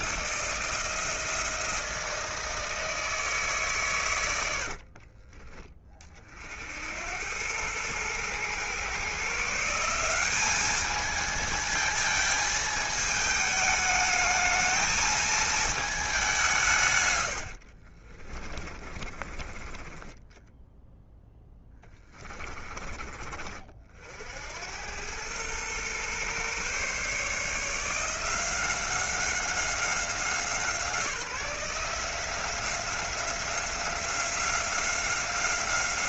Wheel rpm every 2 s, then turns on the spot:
160, 160, 50, 90, 140, 210, 220, 220, 120, 30, 10, 30, 100, 140, 180, 170, 180, 190.
4-6 18-22